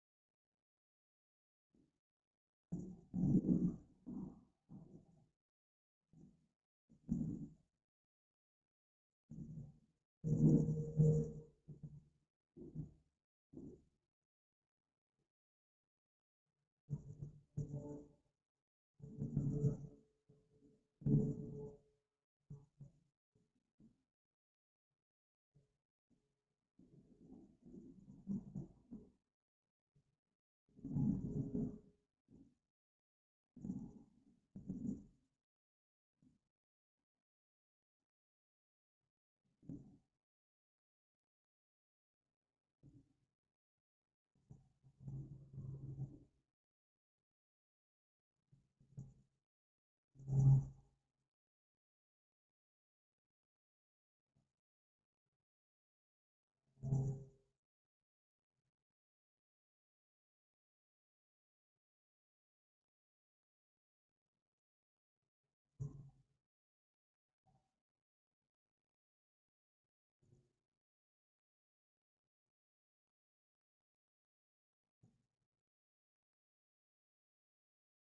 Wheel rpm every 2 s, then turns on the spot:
0, 0, 0, 0, 0, 0, 0, 0, 0, 0, 0, 0, 0, 0, 0, 0, 0, 0, 0, 0, 0, 0, 0, 0, 0, 0, 0, 0, 0, 0, 0, 0, 0, 0, 0, 0, 0, 0, 0.
none